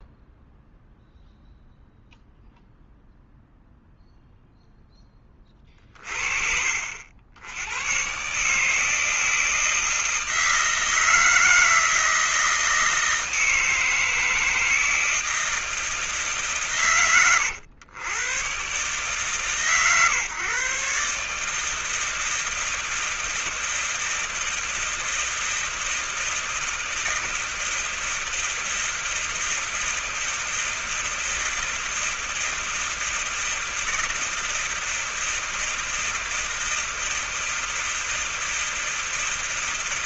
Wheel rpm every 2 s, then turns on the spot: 0, 0, 0, 50, 130, 160, 160, 160, 150, 110, 140, 160, 160, 160, 160, 160, 160, 160, 160, 160.
none